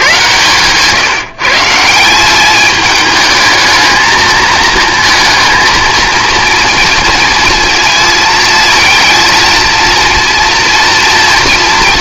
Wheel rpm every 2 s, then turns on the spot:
160, 210, 220, 230, 220, 240.
none